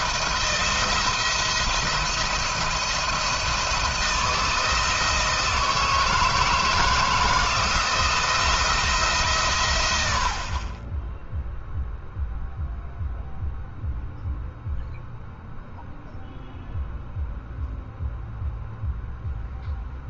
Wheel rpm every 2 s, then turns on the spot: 170, 170, 160, 160, 160, 30, 0, 0, 0, 0.
none